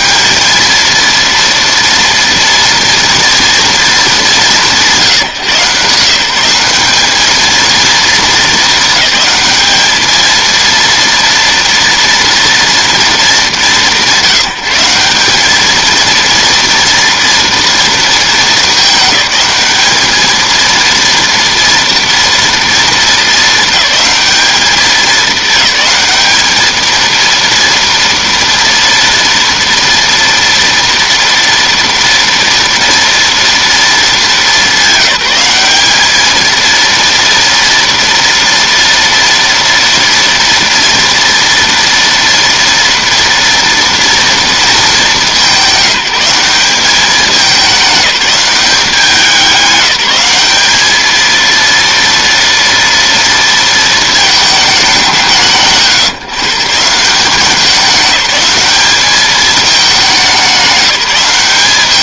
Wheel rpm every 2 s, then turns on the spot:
220, 230, 180, 190, 220, 230, 230, 180, 230, 210, 230, 230, 210, 220, 230, 230, 230, 200, 230, 230, 240, 230, 220, 200, 190, 210, 230, 190, 160, 210, 200.
none